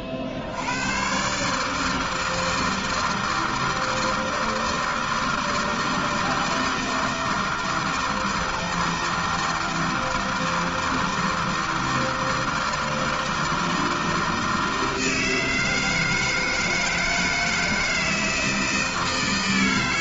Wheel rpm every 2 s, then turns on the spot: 80, 160, 160, 160, 160, 160, 160, 160, 160, 160.
none